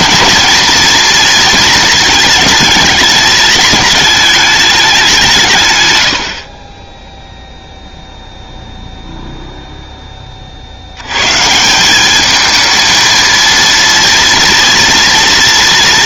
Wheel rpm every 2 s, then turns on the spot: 230, 210, 190, 0, 0, 110, 220, 230.
none